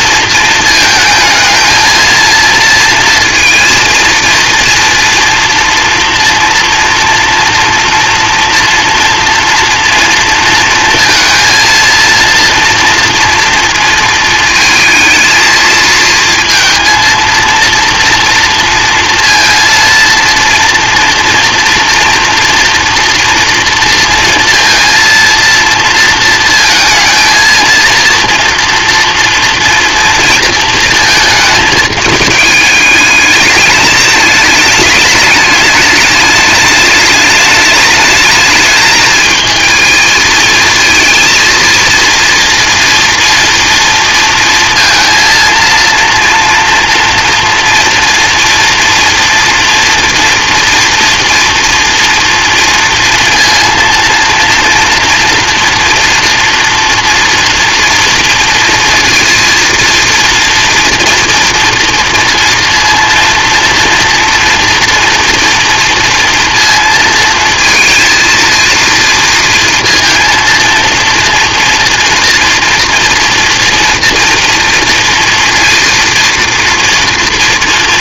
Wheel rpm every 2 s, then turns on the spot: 220, 230, 240, 230, 230, 230, 230, 220, 230, 230, 230, 230, 230, 230, 240, 220, 210, 210, 210, 220, 230, 230, 230, 230, 240, 230, 230, 230, 230, 230, 230, 230, 230, 230, 230, 230, 230, 230, 230.
none